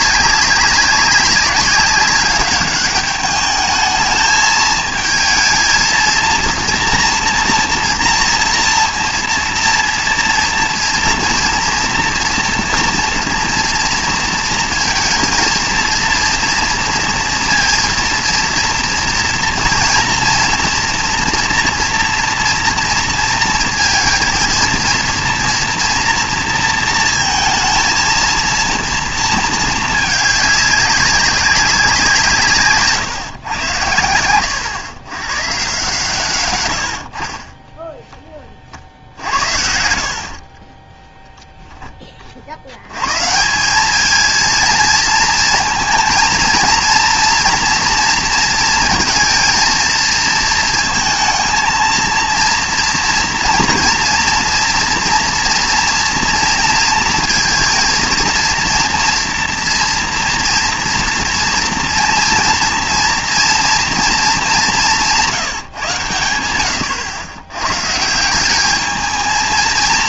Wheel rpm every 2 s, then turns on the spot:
200, 210, 220, 230, 240, 230, 240, 230, 230, 230, 230, 230, 230, 230, 230, 200, 150, 120, 100, 30, 40, 70, 230, 230, 230, 230, 230, 230, 230, 230, 230, 230, 190, 90, 200.
40-42